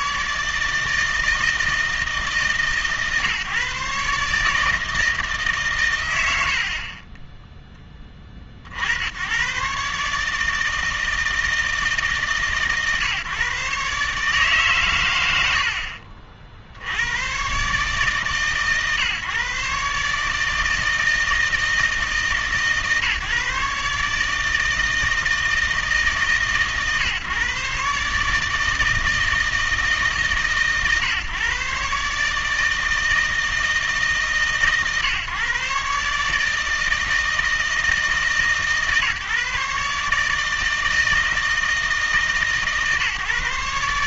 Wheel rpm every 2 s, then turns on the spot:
160, 140, 150, 30, 60, 160, 140, 140, 60, 140, 160, 150, 160, 140, 160, 140, 160, 140, 160, 140, 160, 150.
6-8